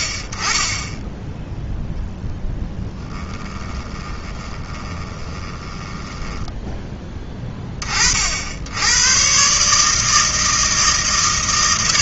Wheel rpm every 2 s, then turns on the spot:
30, 10, 20, 10, 70, 160.
2-8